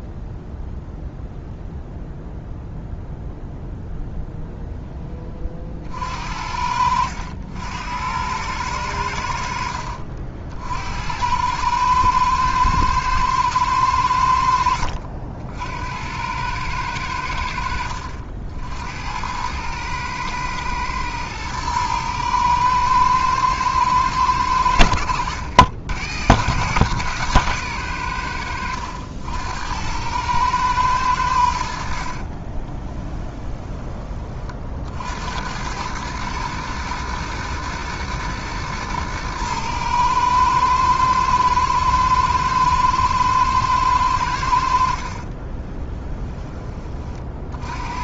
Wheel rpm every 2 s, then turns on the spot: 0, 0, 0, 70, 100, 60, 110, 70, 100, 70, 110, 110, 90, 120, 80, 110, 30, 50, 110, 110, 110, 110, 70, 20.
6-8 14-16 32-34